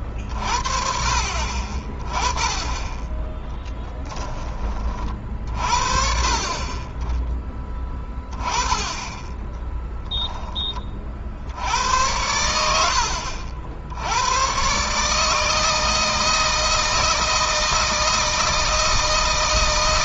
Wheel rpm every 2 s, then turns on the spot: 50, 20, 30, 30, 10, 20, 80, 130, 160, 160.
none